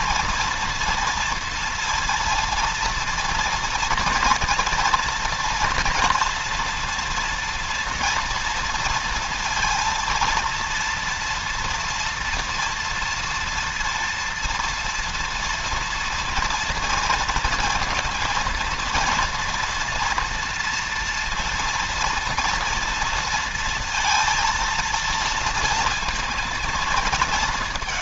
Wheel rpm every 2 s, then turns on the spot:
230, 230, 240, 230, 230, 230, 240, 230, 230, 230, 230, 230, 230, 220.
none